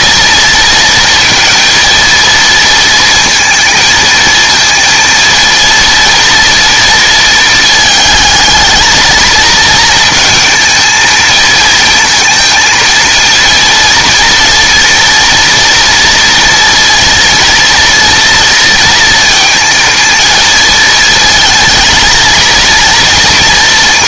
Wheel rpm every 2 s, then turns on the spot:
230, 230, 230, 230, 220, 220, 230, 230, 230, 230, 230, 230.
none